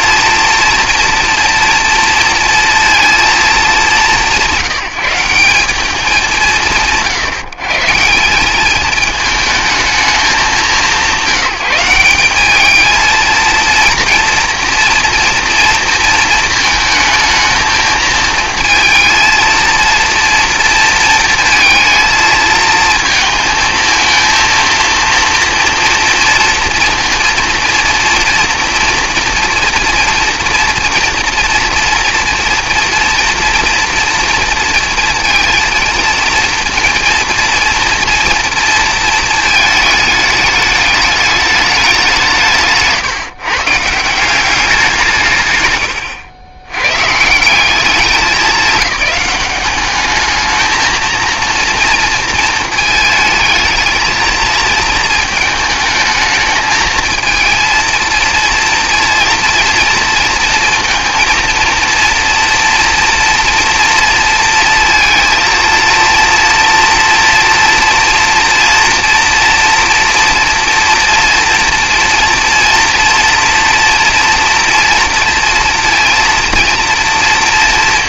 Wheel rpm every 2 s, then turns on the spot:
230, 230, 170, 130, 210, 160, 220, 230, 220, 230, 230, 230, 230, 230, 240, 230, 230, 230, 230, 230, 210, 160, 160, 100, 200, 220, 220, 220, 220, 230, 230, 230, 230, 230, 230, 240, 230, 230, 230.
none